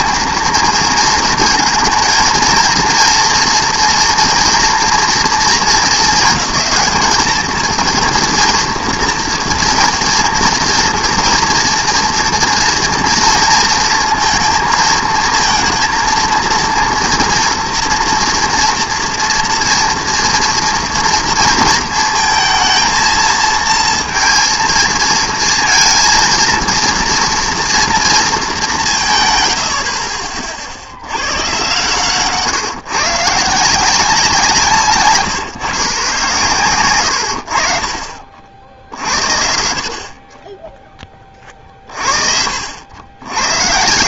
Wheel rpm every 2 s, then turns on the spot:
220, 230, 230, 210, 230, 230, 230, 220, 230, 230, 230, 230, 230, 230, 160, 70, 140, 150, 110, 70, 20, 90.
none